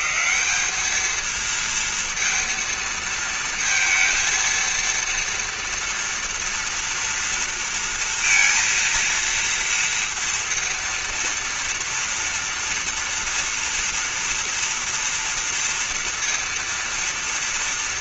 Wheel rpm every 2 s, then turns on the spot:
180, 230, 230, 230, 230, 230, 230, 230, 230.
none